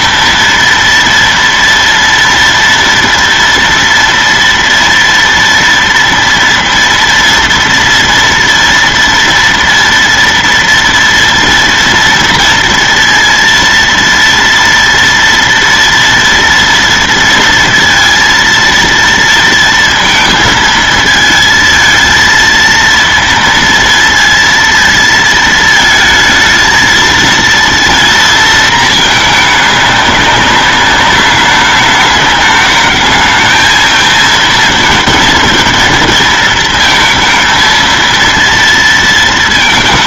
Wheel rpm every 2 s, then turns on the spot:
230, 230, 230, 230, 230, 230, 230, 230, 230, 230, 220, 230, 230, 220, 220, 200, 210, 220, 220, 230.
none